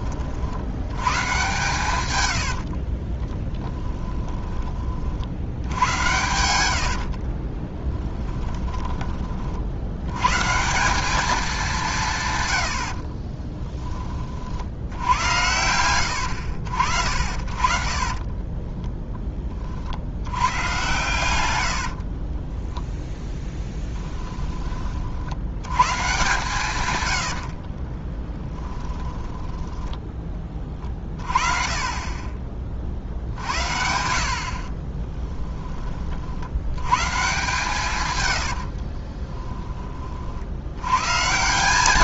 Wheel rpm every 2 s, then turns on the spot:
100, 30, 40, 70, 30, 190, 60, 80, 60, 10, 120, 20, 40, 110, 10, 30, 50, 30, 110, 40, 70.
2-4 6-10 12-14 22-24 28-30 34-36 38-40